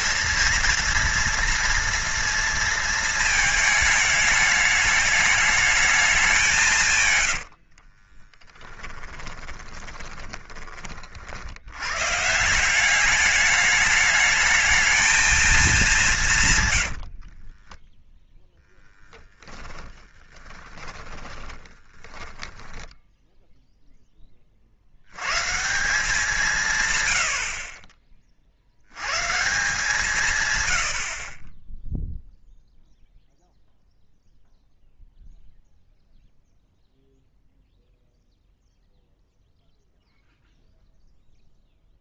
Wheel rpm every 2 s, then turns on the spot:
240, 230, 210, 160, 10, 20, 180, 220, 110, 0, 20, 10, 50, 160, 60, 120, 0, 0, 0, 0, 0.
8-10 16-18 20-24